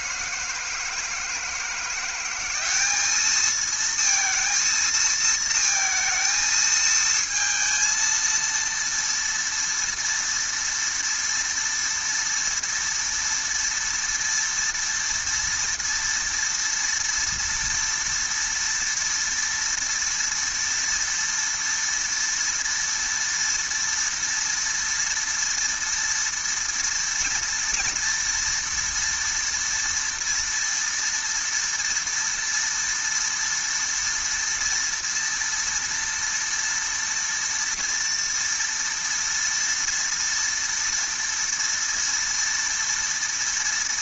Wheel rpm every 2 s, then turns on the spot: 170, 190, 230, 220, 230, 230, 230, 230, 230, 230, 230, 230, 230, 230, 240, 230, 230, 230, 230, 230, 230, 230.
none